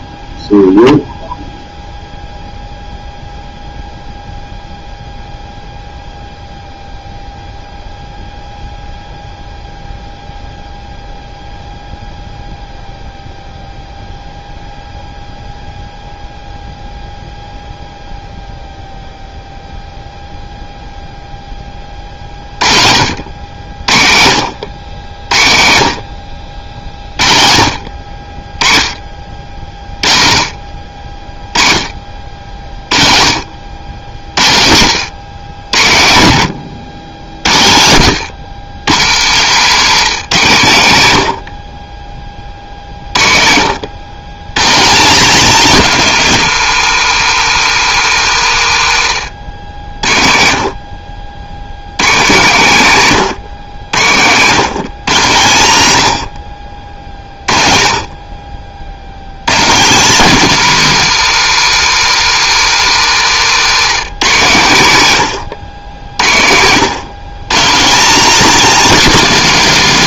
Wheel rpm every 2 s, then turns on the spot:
0, 0, 0, 0, 0, 0, 0, 0, 0, 0, 0, 60, 70, 50, 30, 40, 30, 90, 90, 130, 120, 40, 200, 170, 100, 50, 140, 150, 40, 70, 190, 150, 120, 130, 250.
48-50